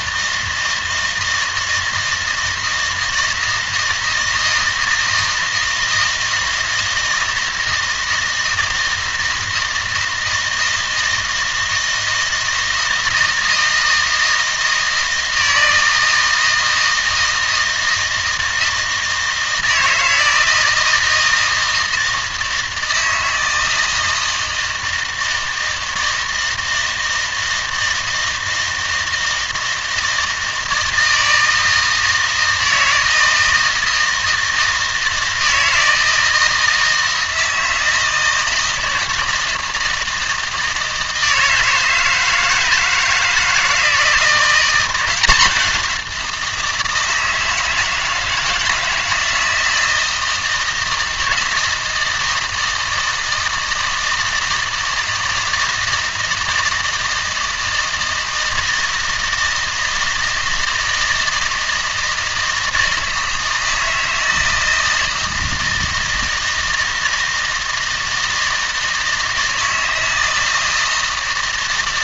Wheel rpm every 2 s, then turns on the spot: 160, 160, 160, 160, 160, 160, 160, 160, 160, 160, 160, 160, 160, 160, 160, 160, 160, 160, 160, 160, 160, 160, 180, 160, 160, 160, 160, 160, 160, 160, 160, 160, 160, 160, 160, 160.
none